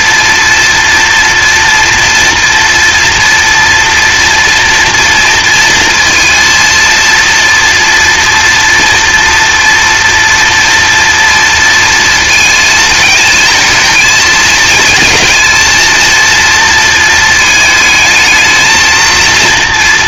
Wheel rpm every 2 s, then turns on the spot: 230, 230, 230, 230, 230, 230, 220, 220, 230, 220.
none